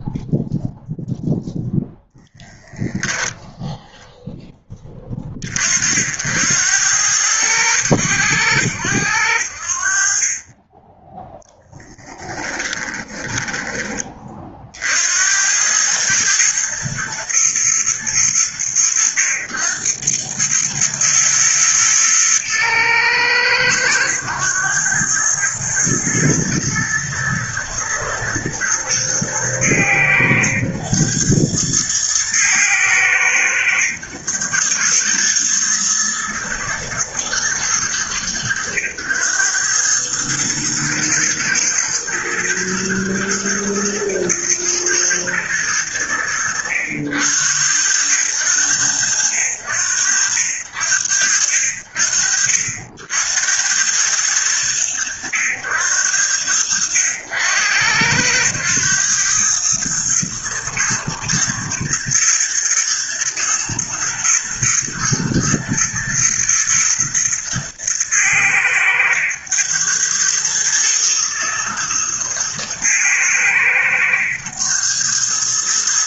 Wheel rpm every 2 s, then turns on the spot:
0, 0, 20, 90, 90, 10, 10, 70, 110, 90, 110, 110, 100, 120, 110, 110, 110, 110, 110, 100, 120, 110, 120, 80, 80, 70, 70, 90, 90, 110, 110, 120, 120, 110, 100, 110, 110, 110.
12-14